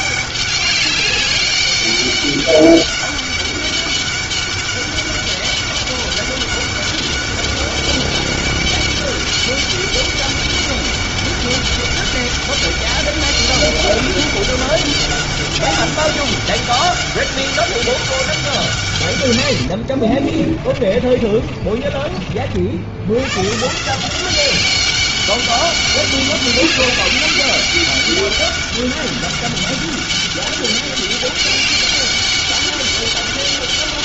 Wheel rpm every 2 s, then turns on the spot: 200, 200, 200, 200, 200, 200, 200, 200, 200, 170, 40, 50, 190, 200, 200, 200, 200.
20-22